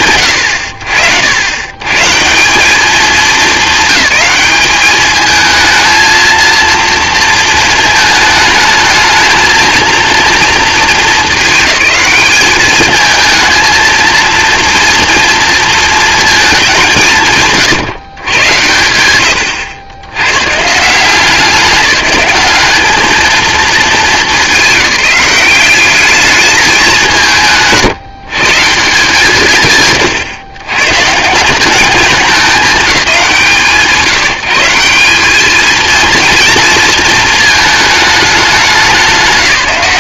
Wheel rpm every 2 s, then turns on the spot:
80, 210, 210, 230, 220, 210, 220, 230, 170, 100, 180, 220, 190, 180, 170, 140, 180, 190, 220, 180.
none